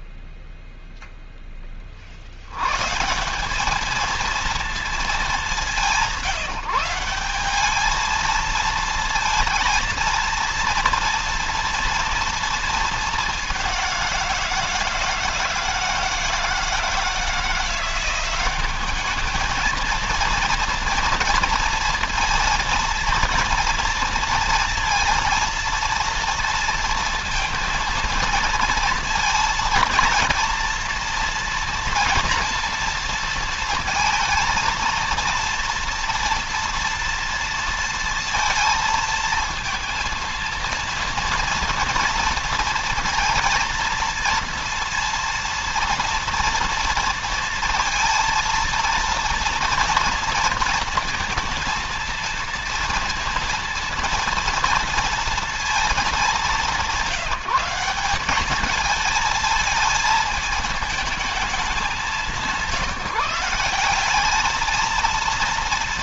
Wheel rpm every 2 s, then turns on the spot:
0, 150, 220, 170, 220, 230, 220, 160, 170, 200, 230, 230, 230, 230, 230, 230, 230, 230, 230, 230, 230, 230, 230, 230, 230, 230, 230, 230, 190, 220, 220, 160, 230.
none